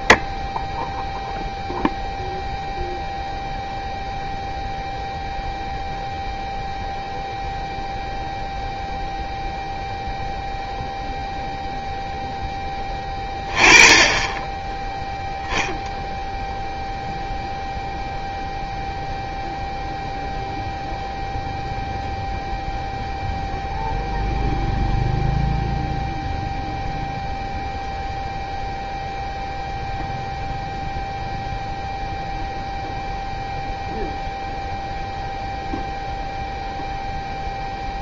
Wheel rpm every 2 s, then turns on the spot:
0, 0, 0, 0, 0, 0, 20, 0, 0, 0, 0, 0, 0, 0, 0, 0, 0, 0, 0.
none